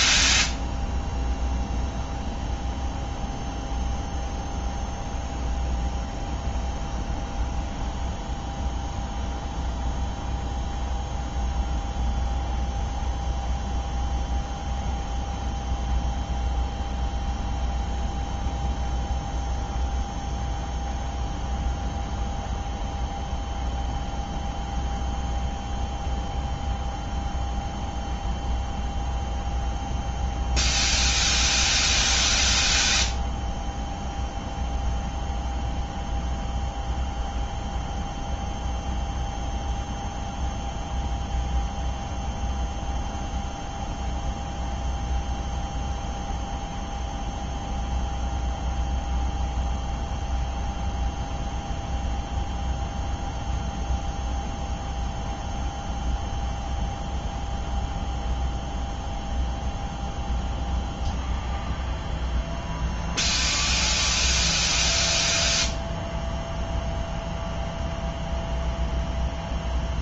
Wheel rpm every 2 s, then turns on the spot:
0, 0, 0, 0, 0, 0, 0, 0, 0, 0, 0, 0, 0, 0, 0, 0, 0, 0, 0, 0, 0, 0, 0, 0, 0, 0, 0, 0, 0, 0, 0, 0, 0, 0, 0.
none